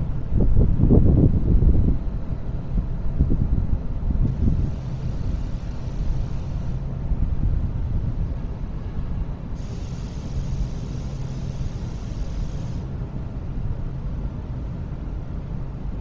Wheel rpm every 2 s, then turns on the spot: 0, 0, 0, 0, 0, 0, 0, 0.
none